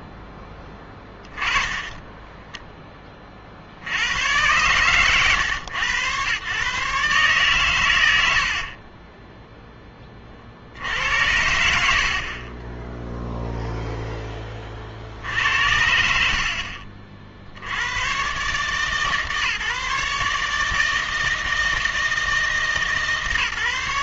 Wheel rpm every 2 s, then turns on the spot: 20, 10, 110, 130, 50, 70, 20, 30, 50, 140, 150, 150.
none